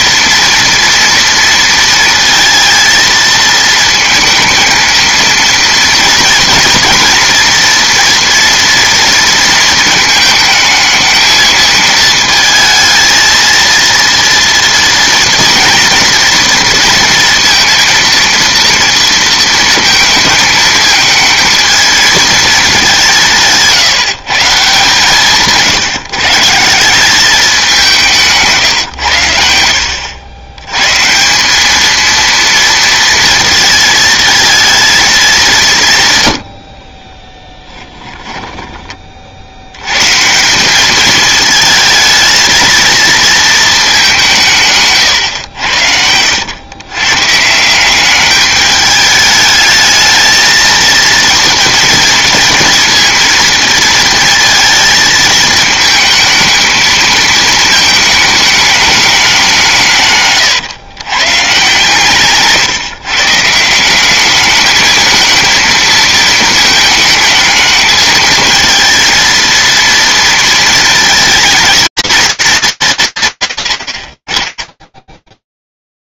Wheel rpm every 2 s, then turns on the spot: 230, 230, 230, 230, 230, 220, 220, 230, 230, 230, 220, 200, 160, 180, 130, 110, 230, 230, 50, 20, 190, 220, 140, 110, 210, 230, 230, 230, 220, 210, 120, 150, 220, 220, 230, 230, 190, 10.
36-38